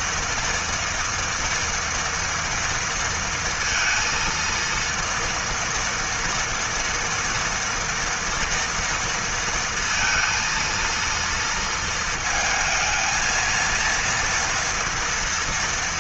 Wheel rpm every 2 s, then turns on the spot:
230, 230, 230, 240, 230, 230, 220, 230.
none